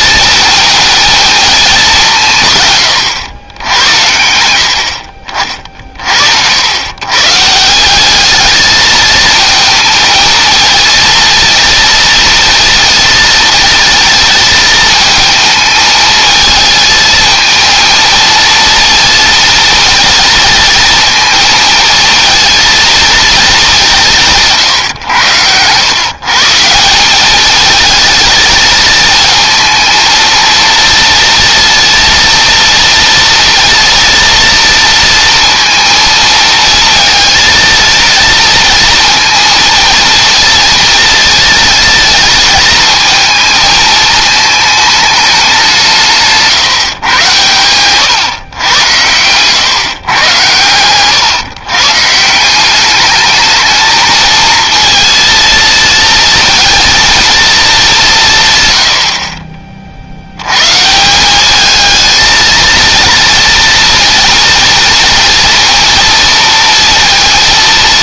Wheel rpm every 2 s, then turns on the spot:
230, 110, 60, 120, 220, 230, 230, 220, 220, 230, 220, 230, 110, 190, 220, 230, 230, 230, 230, 230, 230, 220, 210, 120, 100, 110, 200, 230, 230, 90, 160, 230, 230, 230.
none